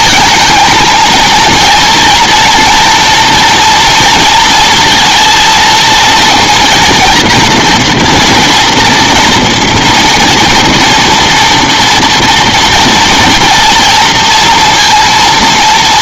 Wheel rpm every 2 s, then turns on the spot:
230, 230, 230, 230, 240, 240, 230, 230.
none